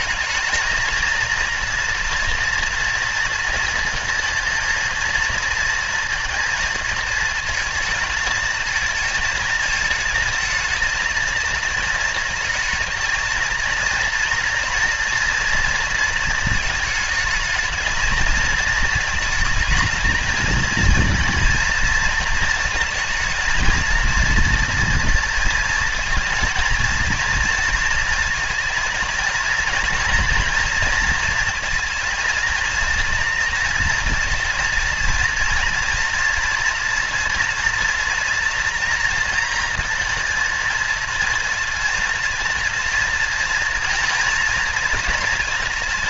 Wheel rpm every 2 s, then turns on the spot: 220, 230, 230, 220, 220, 220, 230, 230, 220, 230, 220, 220, 230, 230, 230, 230, 230, 230, 230, 230, 230, 230, 230.
none